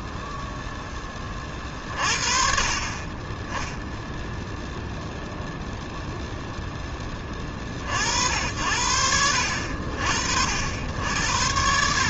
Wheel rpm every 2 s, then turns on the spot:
10, 40, 0, 10, 70, 70.
none